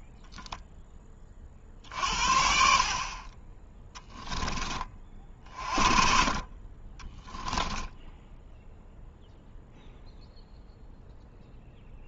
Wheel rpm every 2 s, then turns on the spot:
10, 50, 30, 20, 0, 0.
6-8